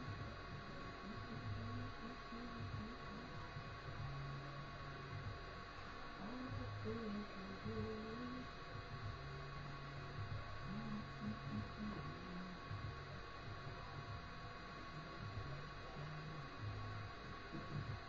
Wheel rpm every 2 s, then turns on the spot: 0, 0, 0, 0, 0, 0, 0, 0, 0.
none